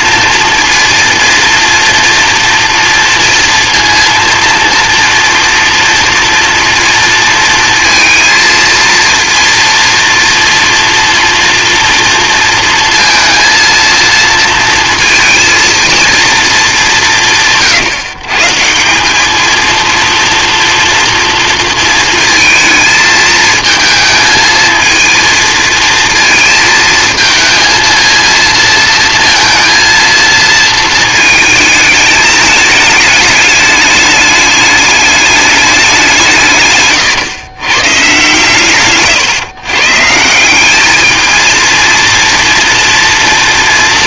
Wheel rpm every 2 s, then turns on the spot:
230, 230, 230, 230, 230, 230, 220, 230, 210, 170, 230, 220, 220, 220, 230, 220, 210, 210, 140, 130, 200, 240.
none